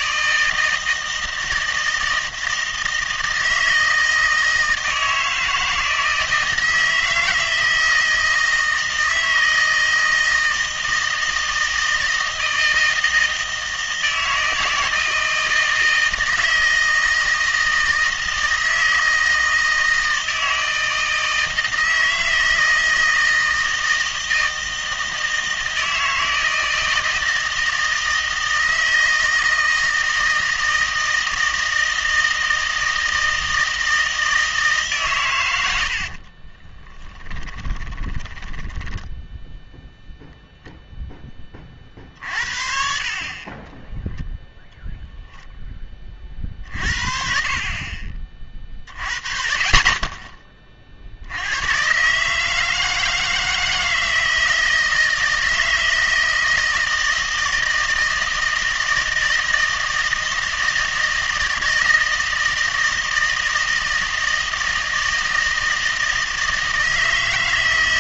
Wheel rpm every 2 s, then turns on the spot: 160, 160, 160, 160, 160, 160, 160, 160, 160, 160, 160, 160, 160, 160, 160, 160, 160, 160, 30, 10, 0, 40, 0, 50, 30, 30, 160, 160, 160, 160, 160, 160, 160, 160.
36-40